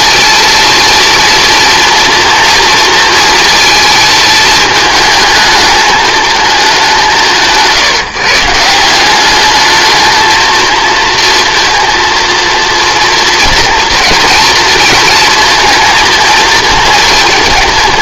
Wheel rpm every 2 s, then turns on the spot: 230, 230, 220, 180, 190, 230, 230, 230, 230.
none